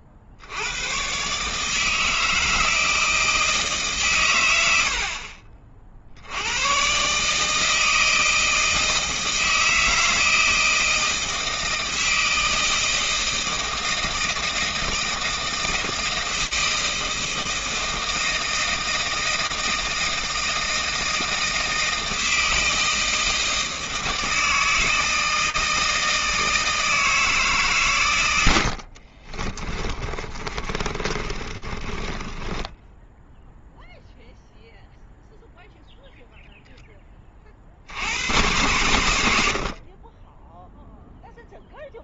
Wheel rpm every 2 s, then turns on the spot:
90, 160, 90, 110, 160, 160, 160, 160, 160, 160, 160, 160, 160, 160, 80, 30, 10, 0, 0, 110, 0.
30-34